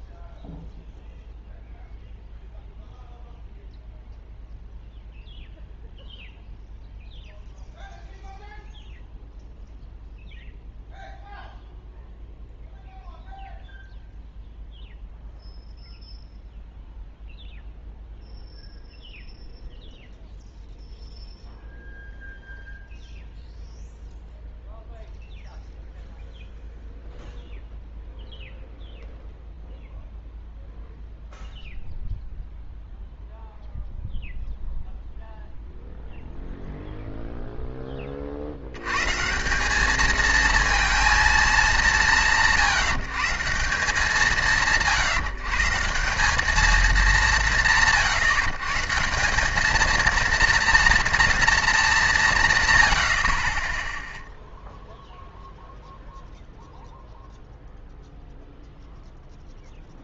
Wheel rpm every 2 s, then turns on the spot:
0, 0, 0, 0, 0, 0, 0, 0, 0, 0, 0, 0, 0, 0, 0, 0, 0, 0, 0, 60, 220, 170, 160, 200, 150, 230, 150, 0, 0, 0.
none